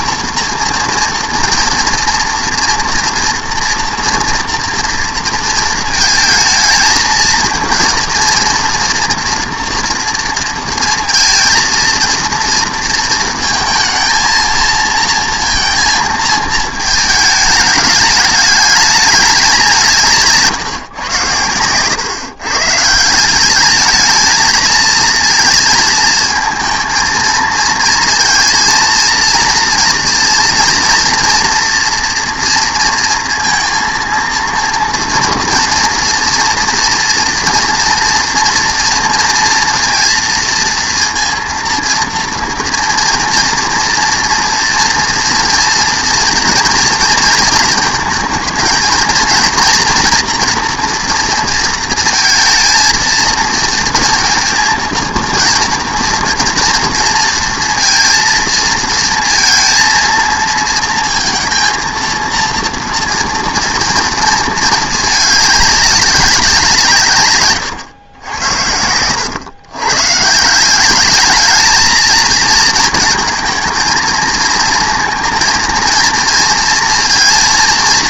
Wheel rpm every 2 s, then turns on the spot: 240, 230, 230, 220, 230, 230, 230, 230, 220, 210, 150, 140, 220, 230, 230, 230, 230, 230, 230, 240, 230, 230, 230, 230, 230, 230, 220, 230, 230, 230, 230, 230, 220, 160, 80, 180, 230, 230, 230.
none